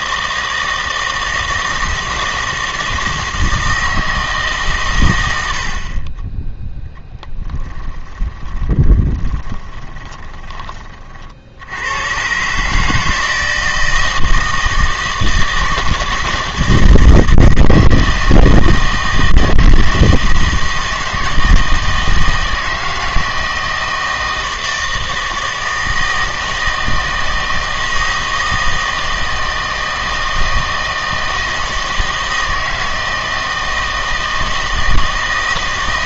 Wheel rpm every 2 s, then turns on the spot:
160, 160, 130, 0, 30, 30, 150, 160, 160, 160, 160, 160, 160, 160, 160, 160, 160, 160.
8-10